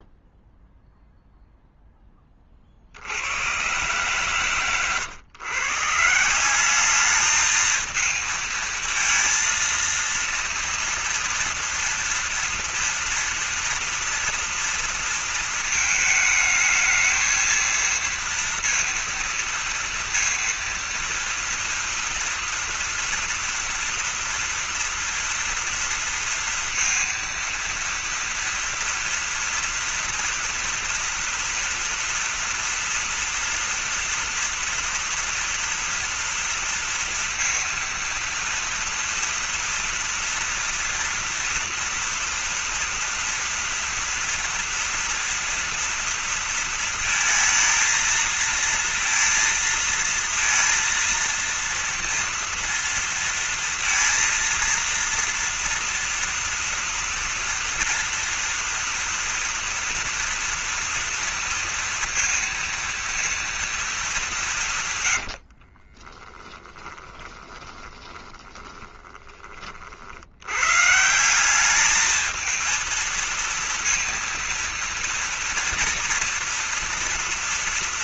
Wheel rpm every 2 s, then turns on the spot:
0, 40, 130, 180, 220, 230, 230, 230, 220, 230, 230, 240, 230, 230, 240, 230, 230, 230, 230, 230, 230, 240, 230, 230, 230, 230, 230, 230, 230, 240, 240, 240, 170, 20, 20, 110, 220, 230, 230.
66-70